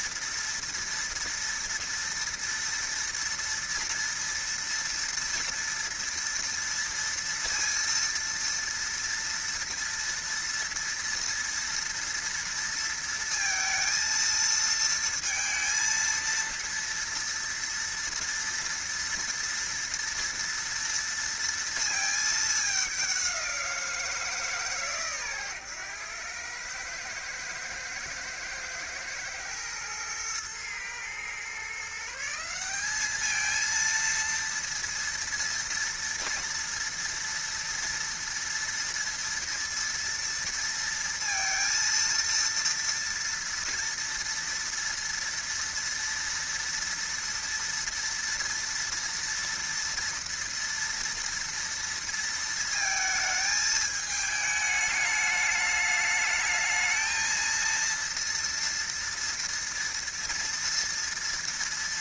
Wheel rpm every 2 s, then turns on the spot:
230, 230, 230, 230, 230, 230, 230, 230, 230, 230, 230, 200, 150, 110, 110, 110, 190, 230, 230, 230, 230, 230, 230, 230, 230, 230, 220, 210, 220, 230, 240.
none